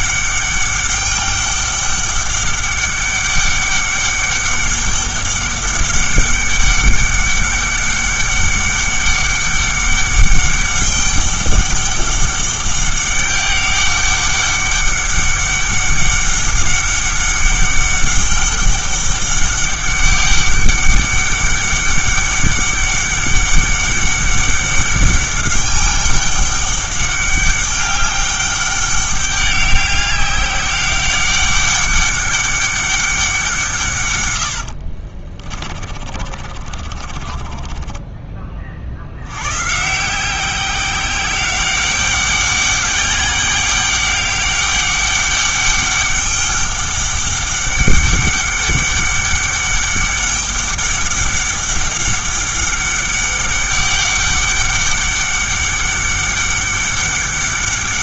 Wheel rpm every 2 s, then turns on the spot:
200, 200, 200, 200, 200, 200, 200, 200, 200, 200, 200, 200, 200, 200, 200, 200, 200, 80, 30, 40, 190, 200, 200, 200, 200, 200, 200, 200, 200.
34-38